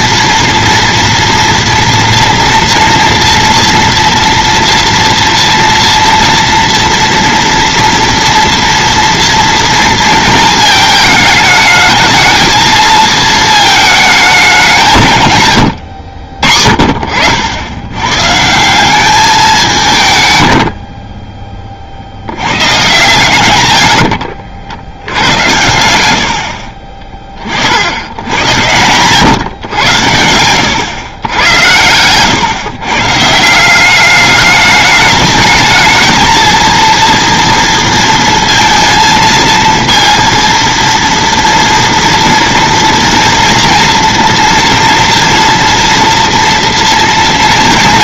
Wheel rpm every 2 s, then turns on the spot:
230, 230, 230, 230, 230, 220, 220, 170, 70, 180, 60, 120, 80, 40, 120, 120, 130, 210, 230, 230, 230, 230, 230, 220.
20-22